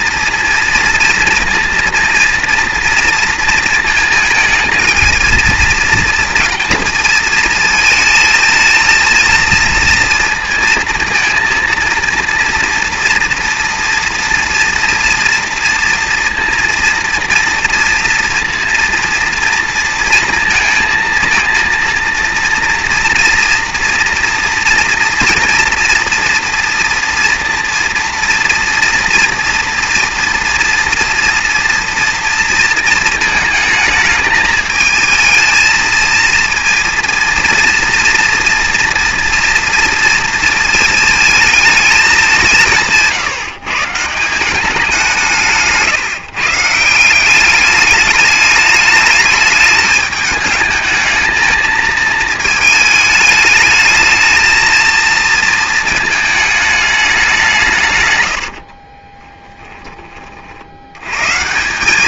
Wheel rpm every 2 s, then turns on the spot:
230, 230, 220, 230, 220, 230, 230, 230, 230, 230, 230, 230, 240, 230, 240, 230, 230, 220, 230, 230, 220, 170, 190, 150, 210, 220, 220, 220, 210, 60, 70.
58-60